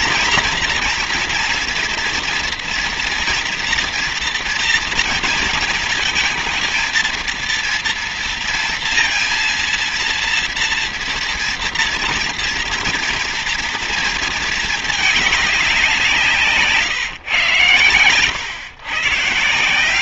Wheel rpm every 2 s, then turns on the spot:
240, 230, 230, 230, 230, 240, 230, 220, 140, 130.
none